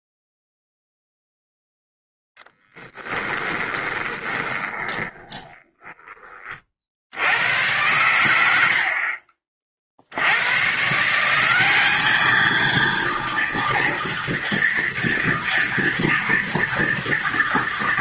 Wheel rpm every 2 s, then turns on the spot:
0, 10, 20, 30, 90, 100, 220, 230, 230.
2-6